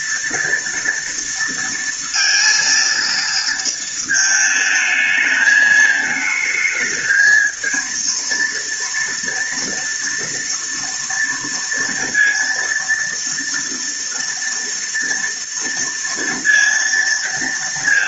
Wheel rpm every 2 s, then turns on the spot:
240, 230, 220, 220, 230, 230, 230, 230, 230.
none